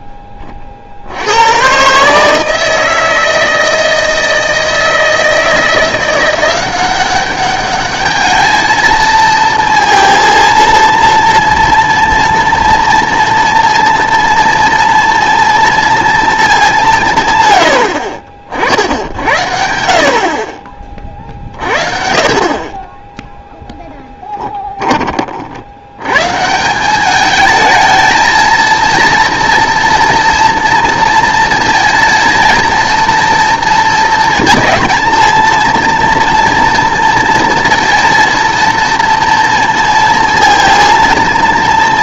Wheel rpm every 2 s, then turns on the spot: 30, 160, 160, 180, 220, 230, 240, 230, 190, 60, 30, 30, 10, 170, 230, 230, 230, 220, 240, 230, 230.
24-26